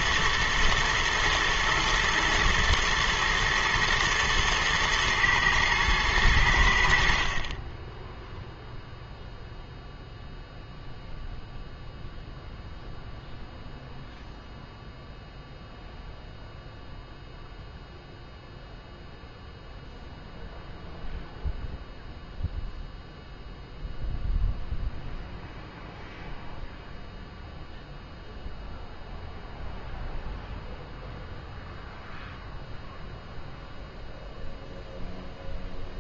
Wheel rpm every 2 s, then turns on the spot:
110, 120, 110, 80, 0, 0, 0, 0, 0, 0, 0, 0, 0, 0, 0, 0, 0, 0.
none